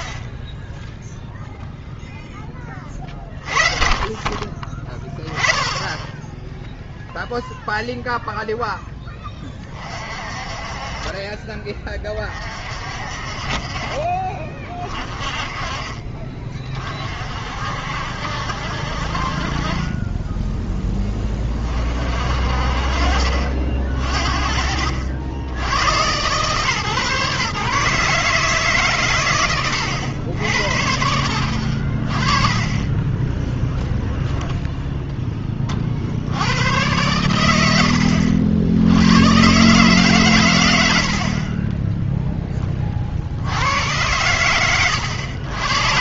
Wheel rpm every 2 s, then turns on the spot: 10, 20, 30, 0, 0, 30, 40, 30, 30, 60, 10, 60, 50, 130, 150, 70, 30, 0, 100, 70, 100, 20, 100.
32-34